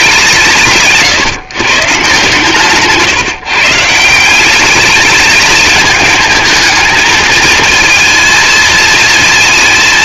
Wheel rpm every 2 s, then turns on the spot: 150, 140, 190, 220, 220.
none